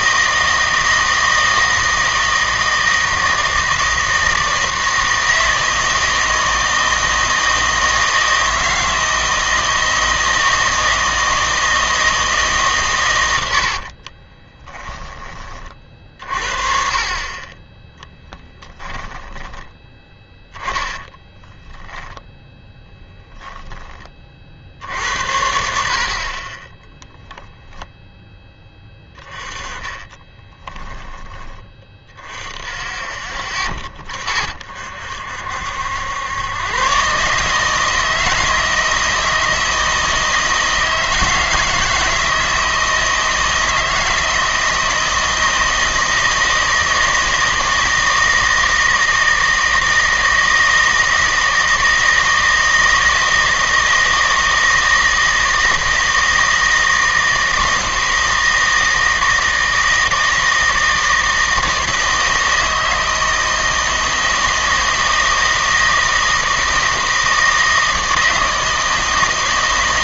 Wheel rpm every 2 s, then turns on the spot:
160, 160, 160, 160, 160, 160, 140, 20, 40, 10, 10, 20, 70, 20, 10, 10, 40, 50, 120, 160, 160, 160, 160, 160, 160, 160, 160, 160, 160, 160, 160, 160, 160, 160, 160.
14-16 18-24 30-32